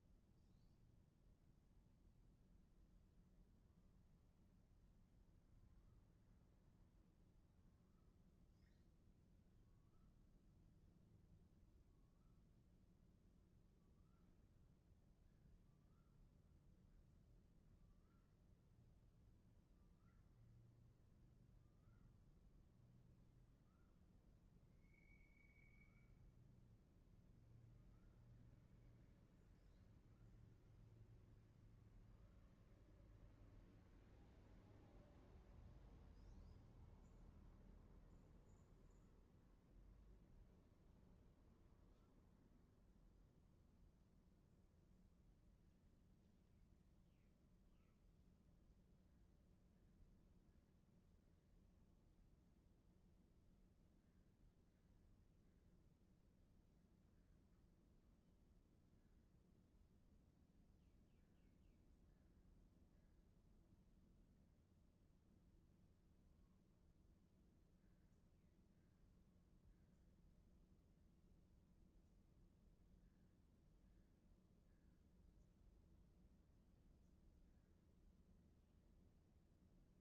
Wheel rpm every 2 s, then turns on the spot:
0, 0, 0, 0, 0, 0, 0, 0, 0, 0, 0, 0, 0, 0, 0, 0, 0, 0, 0, 0, 0, 0, 0, 0, 0, 0, 0, 0, 0, 0, 0, 0, 0, 0, 0, 0, 0, 0, 0, 0.
none